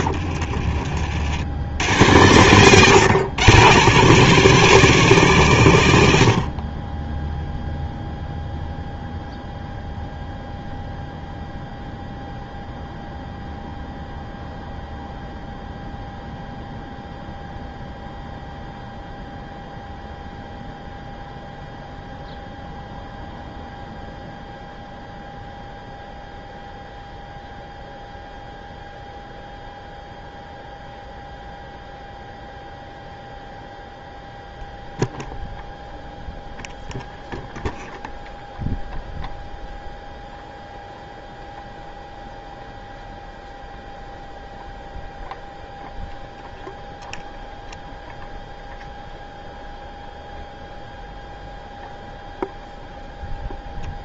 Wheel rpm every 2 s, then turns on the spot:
60, 130, 180, 40, 0, 0, 0, 0, 0, 0, 0, 0, 0, 0, 0, 0, 0, 0, 0, 0, 0, 0, 0, 0, 0, 0, 0.
0-2